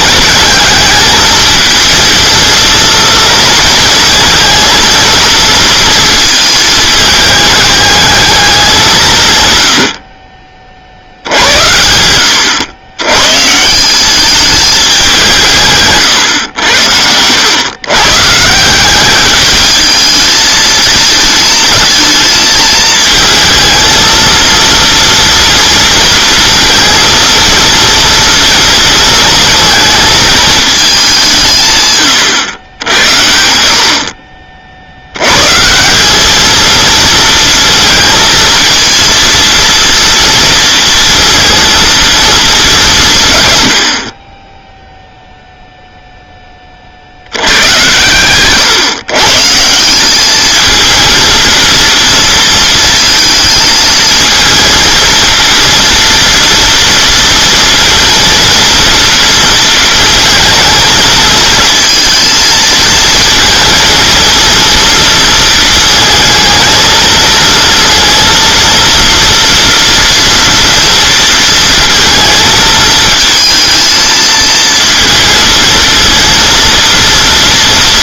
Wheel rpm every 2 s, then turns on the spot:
220, 230, 220, 220, 190, 50, 100, 210, 90, 180, 220, 220, 230, 230, 230, 210, 100, 60, 220, 230, 230, 200, 10, 30, 120, 220, 220, 230, 230, 240, 220, 220, 230, 220, 230, 230, 220, 220, 230.
none